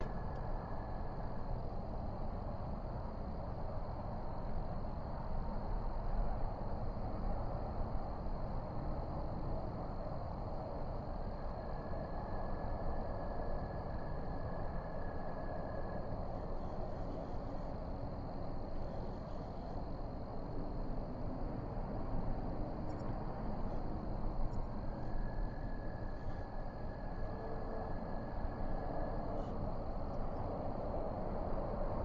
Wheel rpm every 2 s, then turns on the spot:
0, 0, 0, 0, 0, 0, 0, 0, 0, 0, 0, 0, 0, 0, 0, 0.
none